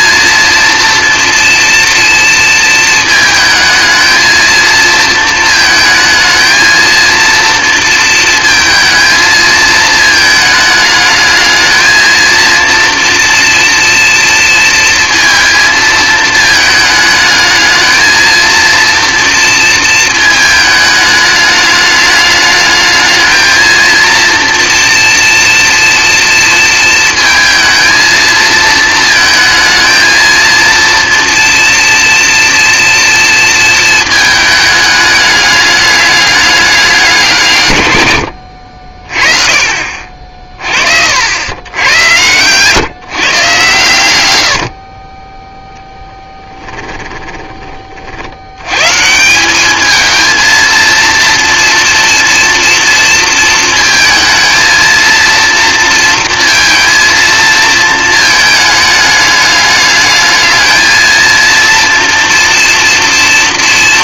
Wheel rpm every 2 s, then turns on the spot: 230, 220, 230, 230, 220, 220, 230, 230, 220, 230, 220, 210, 230, 230, 230, 230, 240, 220, 210, 60, 40, 120, 90, 10, 80, 220, 230, 230, 230, 210, 220, 230.
46-48